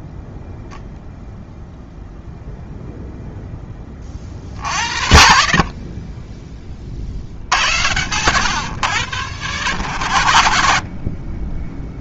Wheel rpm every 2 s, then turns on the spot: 0, 0, 50, 20, 120, 60.
none